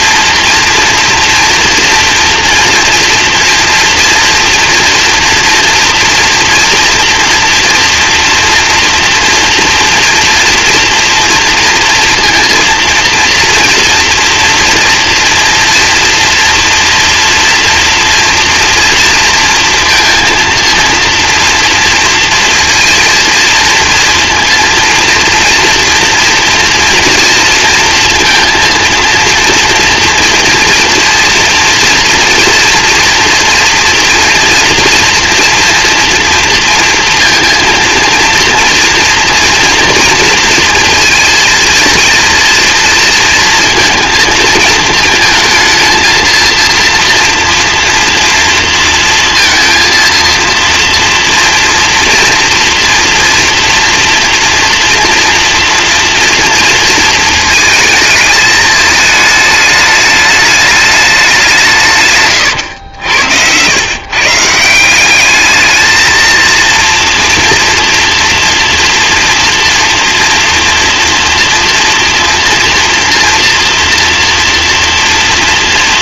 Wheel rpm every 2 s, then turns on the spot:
230, 230, 240, 240, 230, 230, 230, 230, 230, 230, 230, 230, 230, 230, 230, 240, 230, 230, 230, 230, 230, 230, 220, 230, 230, 230, 230, 230, 230, 210, 210, 100, 170, 230, 230, 230, 230, 230.
62-64